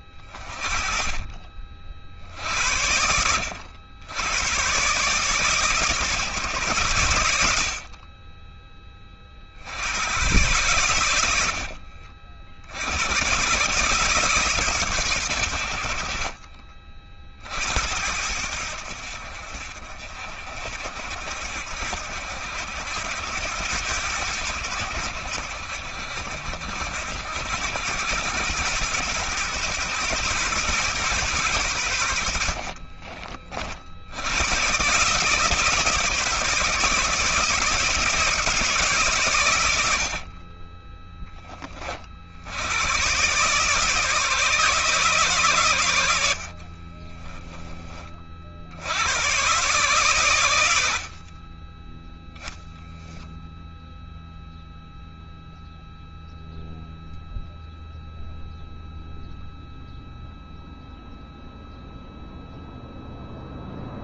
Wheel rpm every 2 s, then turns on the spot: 30, 80, 140, 100, 30, 90, 100, 120, 50, 70, 60, 90, 80, 80, 110, 130, 40, 130, 160, 140, 20, 100, 140, 30, 100, 60, 0, 0, 0, 0, 0, 0.
32-34 46-48 50-52